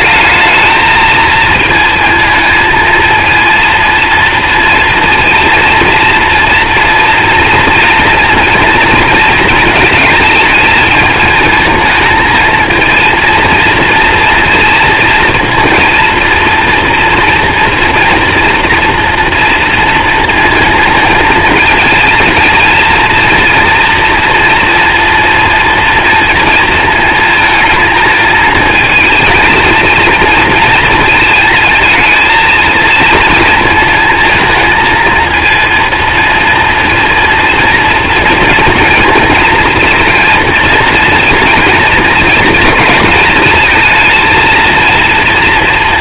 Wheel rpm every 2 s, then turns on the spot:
220, 230, 230, 230, 230, 220, 230, 230, 230, 230, 230, 230, 230, 230, 220, 230, 220, 220, 230, 230, 230, 220, 230.
none